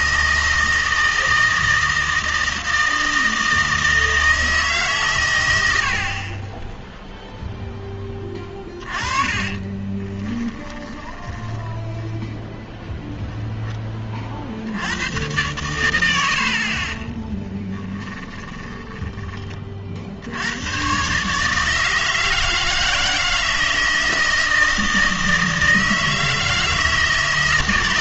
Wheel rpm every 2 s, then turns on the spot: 160, 160, 150, 10, 20, 20, 0, 70, 50, 20, 100, 160, 160, 160.
6-12 16-20